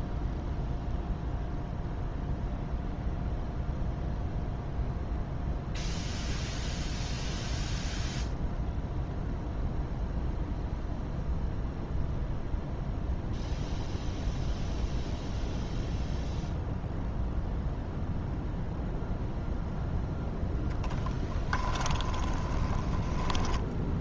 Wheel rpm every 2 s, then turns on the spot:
0, 0, 0, 0, 0, 0, 0, 0, 0, 0, 0, 20.
22-24